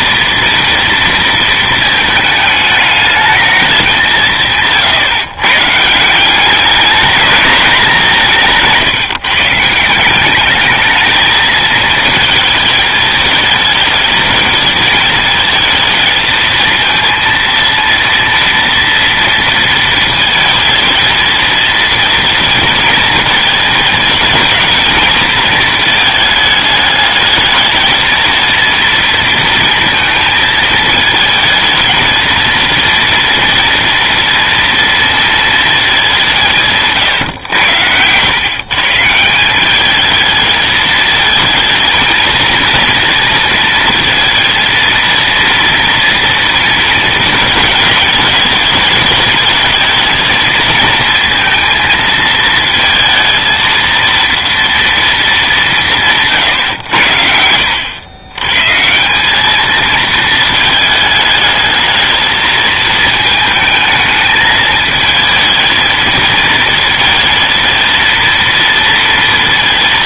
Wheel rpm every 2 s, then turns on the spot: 230, 220, 140, 200, 160, 210, 220, 220, 230, 230, 220, 230, 220, 220, 230, 220, 230, 230, 150, 140, 220, 230, 230, 230, 210, 230, 220, 230, 110, 140, 220, 220, 220, 230, 230.
8-10